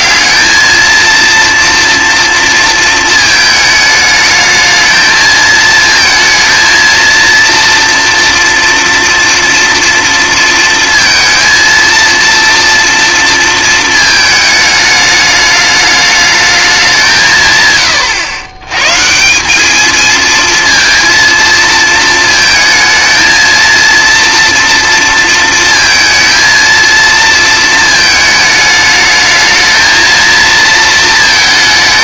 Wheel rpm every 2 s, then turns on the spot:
220, 230, 220, 230, 240, 230, 230, 210, 190, 120, 230, 220, 230, 230, 210, 230.
none